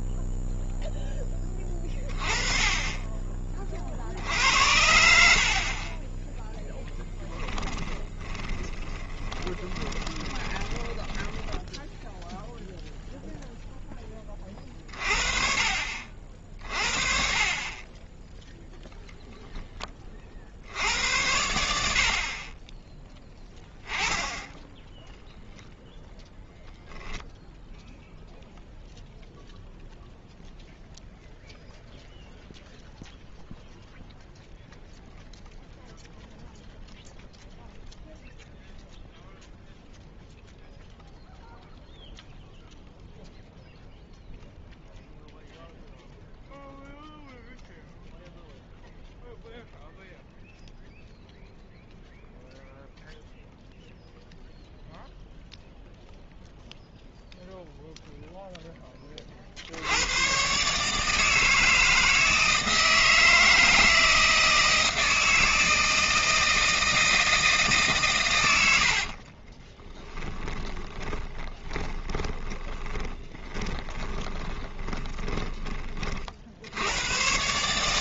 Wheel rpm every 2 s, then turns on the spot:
0, 20, 70, 0, 20, 10, 0, 30, 40, 0, 70, 20, 10, 0, 0, 0, 0, 0, 0, 0, 0, 0, 0, 0, 0, 0, 0, 0, 0, 10, 140, 160, 160, 160, 80, 20, 20, 20, 90.
8-12 68-76